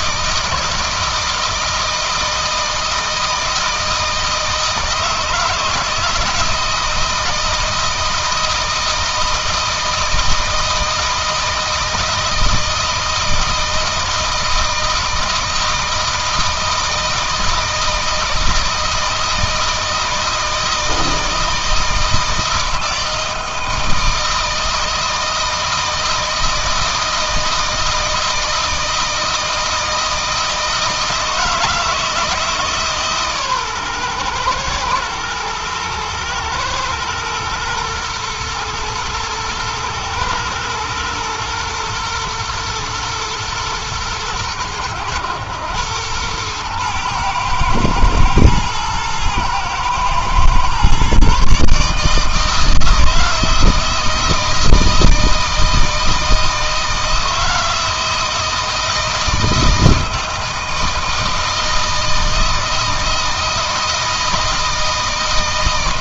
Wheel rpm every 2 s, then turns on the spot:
160, 160, 160, 160, 160, 160, 160, 160, 160, 160, 160, 160, 160, 160, 160, 160, 150, 110, 120, 110, 120, 120, 100, 110, 110, 130, 160, 160, 160, 160, 160, 160, 160.
none